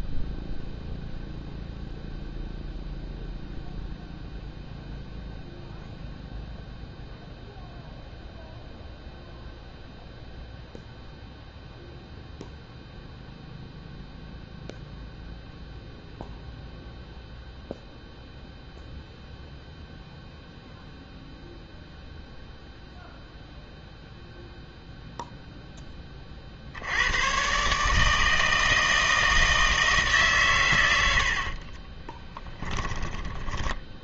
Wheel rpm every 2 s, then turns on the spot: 0, 0, 0, 0, 0, 0, 0, 0, 0, 0, 0, 0, 0, 60, 160, 120, 20.
32-34